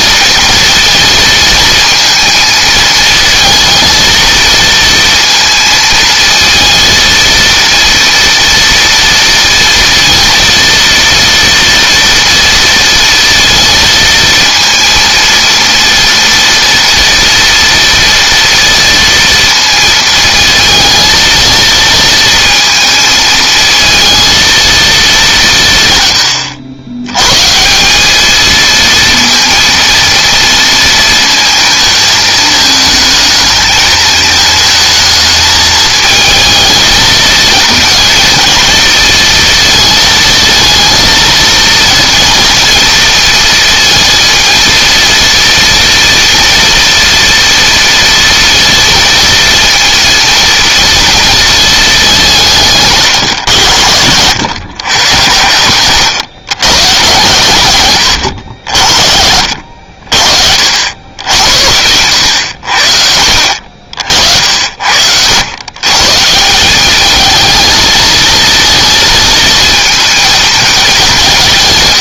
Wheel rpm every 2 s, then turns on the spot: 230, 220, 230, 230, 230, 230, 230, 230, 230, 230, 220, 220, 220, 100, 220, 230, 220, 220, 220, 230, 230, 230, 230, 230, 230, 230, 160, 110, 130, 60, 70, 70, 70, 190, 230, 210.
none